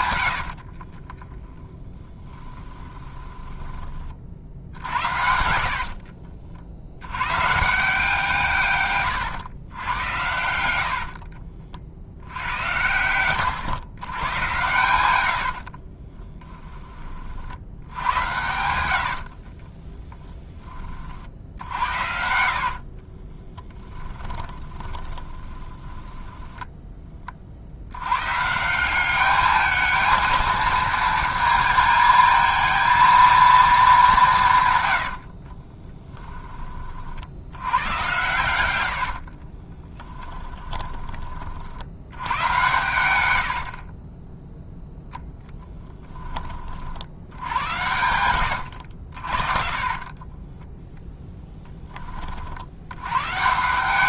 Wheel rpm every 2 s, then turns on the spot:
50, 10, 60, 70, 140, 70, 90, 100, 20, 90, 20, 50, 30, 10, 170, 230, 220, 120, 30, 90, 20, 120, 0, 30, 90, 20, 70.
0-6 18-20 22-26 38-42 48-52